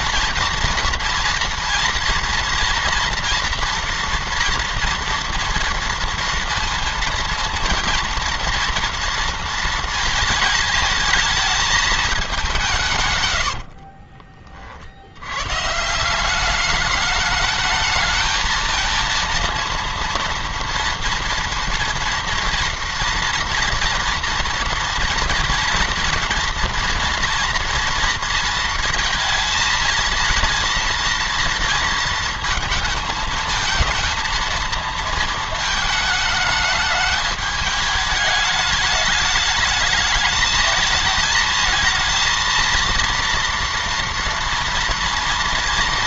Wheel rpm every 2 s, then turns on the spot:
230, 230, 230, 230, 230, 220, 160, 50, 210, 230, 230, 240, 240, 230, 230, 230, 220, 230, 210, 210, 220, 230, 230.
none